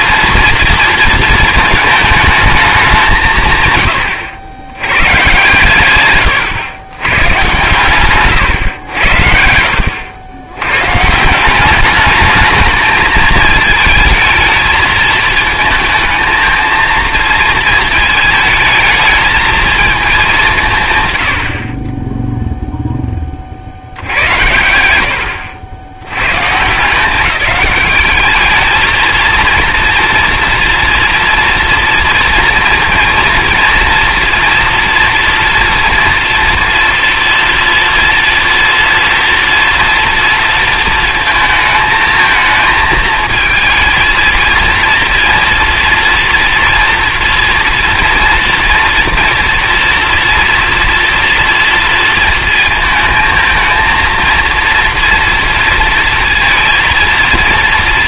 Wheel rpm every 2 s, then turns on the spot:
230, 200, 100, 120, 110, 110, 210, 220, 230, 220, 140, 0, 80, 150, 220, 240, 230, 240, 240, 240, 230, 220, 230, 230, 230, 240, 220, 230, 230.
none